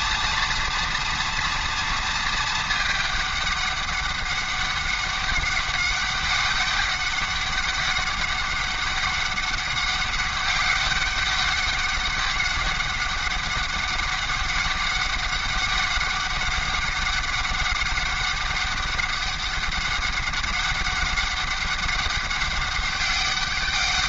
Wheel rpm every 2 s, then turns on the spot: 230, 220, 200, 200, 200, 200, 200, 200, 200, 200, 200, 200.
none